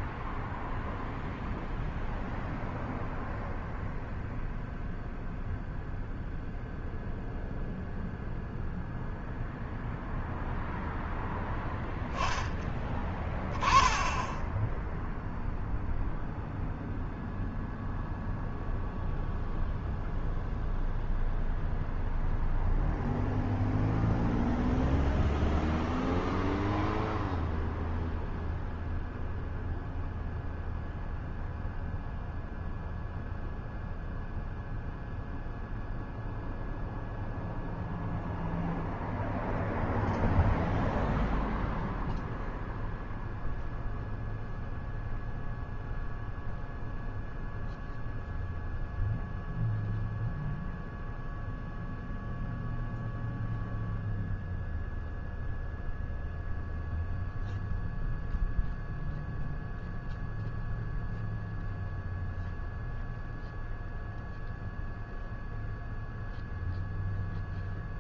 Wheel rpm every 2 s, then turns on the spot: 0, 0, 0, 0, 0, 0, 10, 0, 0, 0, 0, 0, 0, 0, 0, 0, 0, 0, 0, 0, 0, 0, 0, 0, 0, 0, 0, 0, 0, 0, 0, 0, 0, 0.
none